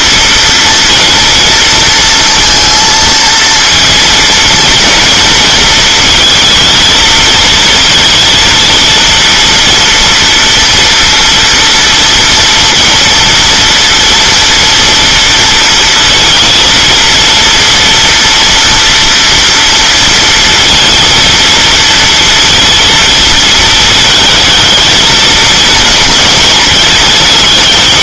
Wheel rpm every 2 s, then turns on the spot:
230, 230, 230, 220, 230, 230, 230, 230, 230, 230, 230, 230, 220, 210.
none